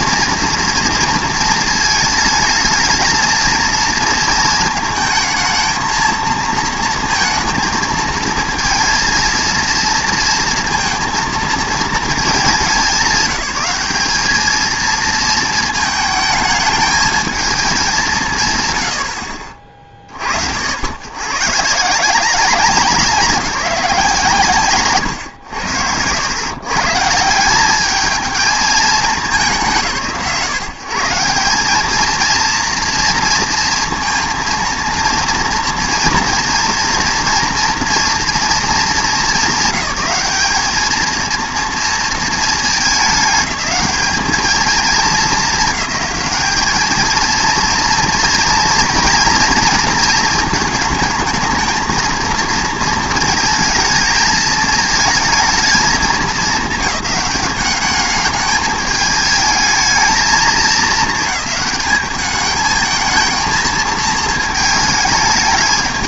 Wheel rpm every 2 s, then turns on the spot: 230, 220, 220, 230, 230, 230, 180, 230, 220, 100, 90, 180, 130, 130, 220, 150, 230, 230, 230, 220, 210, 220, 220, 220, 230, 220, 230, 220, 200, 210, 220, 210, 220.
none